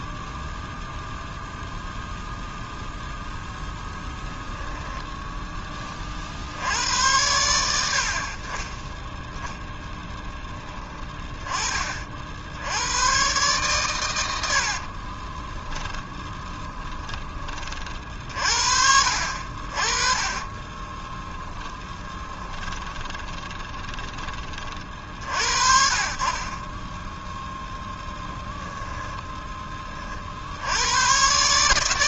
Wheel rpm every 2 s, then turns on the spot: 0, 0, 10, 90, 20, 20, 100, 50, 10, 60, 20, 20, 40, 20, 10, 90.
4-6 10-12 14-18 20-24 28-30